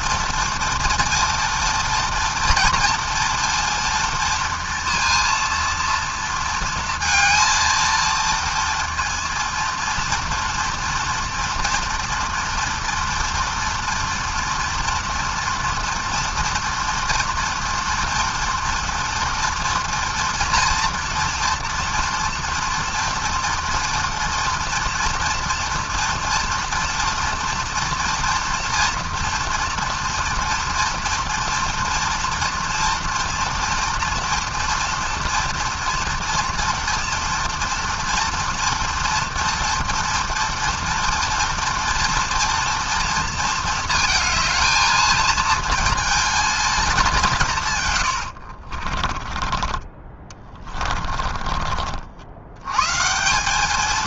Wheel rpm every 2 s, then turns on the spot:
230, 230, 230, 230, 230, 230, 230, 230, 230, 240, 230, 240, 230, 230, 230, 230, 230, 230, 240, 240, 230, 230, 220, 180, 20, 40, 180.
48-52